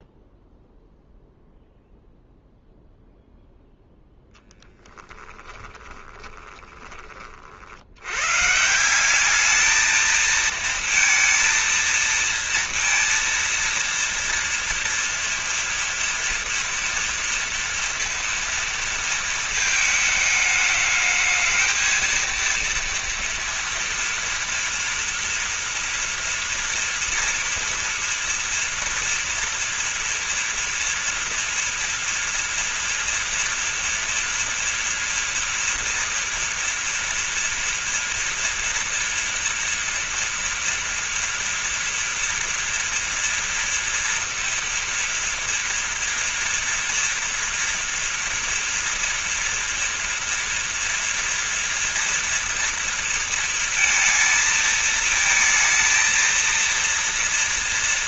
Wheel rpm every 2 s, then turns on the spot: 0, 0, 10, 20, 170, 230, 230, 230, 230, 220, 220, 230, 230, 230, 230, 230, 230, 230, 230, 230, 230, 230, 230, 230, 230, 230, 230, 220, 230.
none